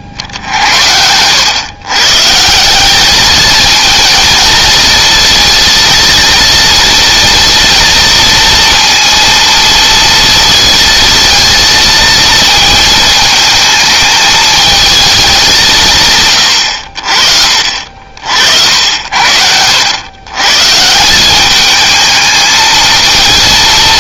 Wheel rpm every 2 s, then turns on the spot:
80, 180, 220, 230, 230, 230, 220, 220, 90, 70, 140, 220.
none